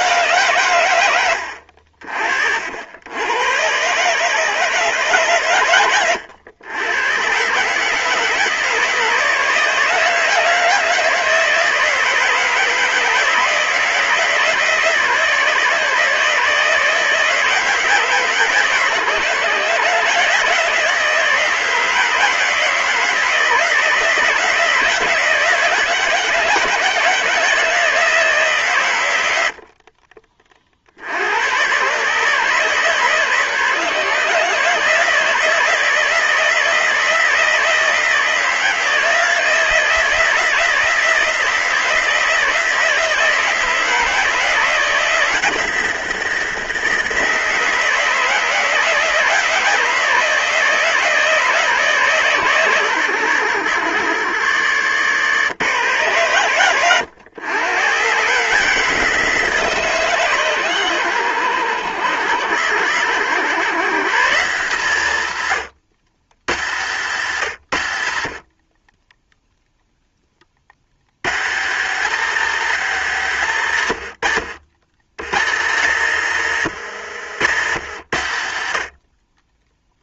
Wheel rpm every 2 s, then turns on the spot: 100, 90, 130, 110, 160, 160, 160, 160, 160, 150, 160, 160, 160, 150, 100, 70, 140, 150, 160, 160, 160, 160, 170, 160, 160, 160, 110, 100, 110, 160, 110, 100, 120, 120, 20, 100, 180, 100, 130, 60.
68-70 76-78